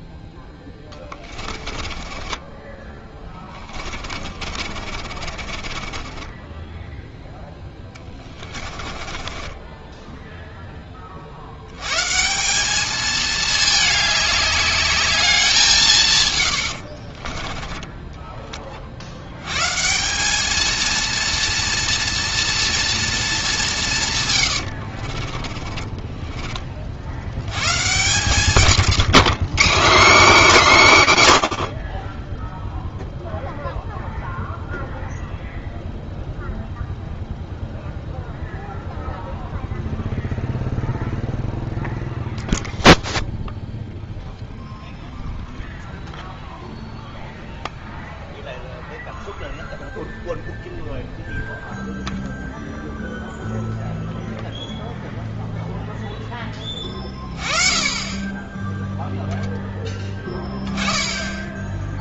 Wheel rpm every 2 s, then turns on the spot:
0, 20, 40, 10, 20, 20, 210, 210, 80, 60, 230, 230, 60, 40, 150, 160, 0, 0, 0, 0, 0, 0, 0, 0, 0, 0, 0, 0, 20, 10, 10.
2-10 16-18 24-26